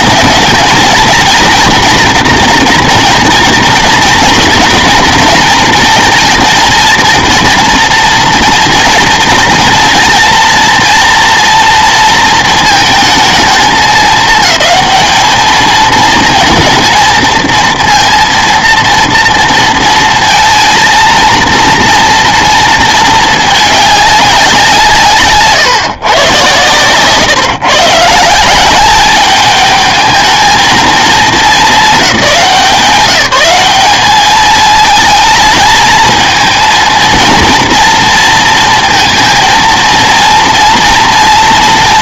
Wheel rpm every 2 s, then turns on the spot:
230, 230, 230, 220, 230, 240, 220, 220, 220, 230, 230, 220, 170, 120, 200, 220, 180, 220, 230, 220, 240.
none